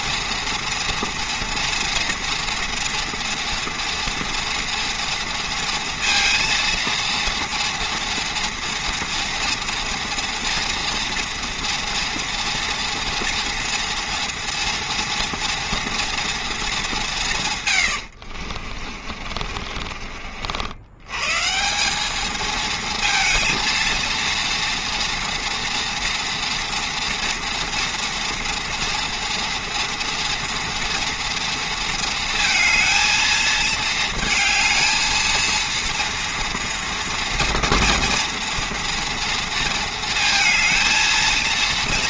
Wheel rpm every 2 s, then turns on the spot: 230, 230, 240, 230, 230, 230, 240, 230, 220, 50, 70, 220, 230, 230, 230, 240, 230, 220, 230, 230, 230.
18-20